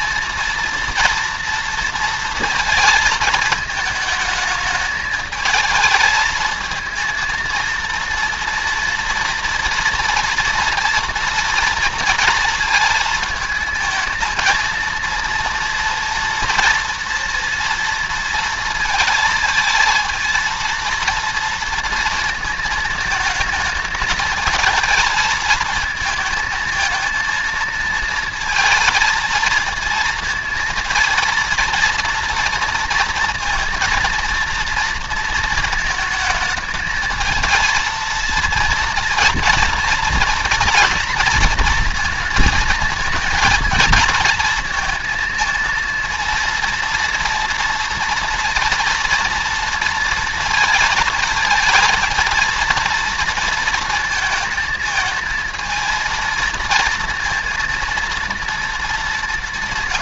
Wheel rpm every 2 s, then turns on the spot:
230, 220, 210, 230, 240, 240, 230, 230, 230, 220, 230, 220, 220, 230, 230, 230, 230, 230, 220, 230, 230, 220, 230, 230, 230, 230, 230, 220, 230, 210.
none